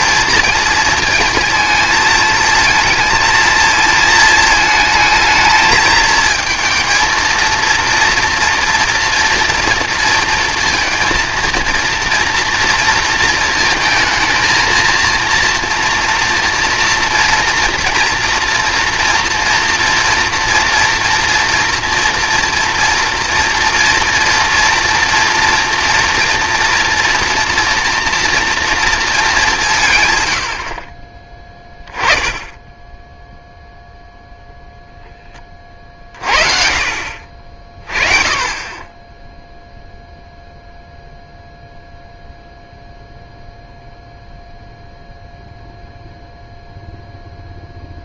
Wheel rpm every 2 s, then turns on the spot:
220, 220, 220, 220, 230, 230, 230, 220, 230, 230, 230, 230, 230, 230, 230, 50, 10, 0, 50, 20, 0, 0, 0, 0.
none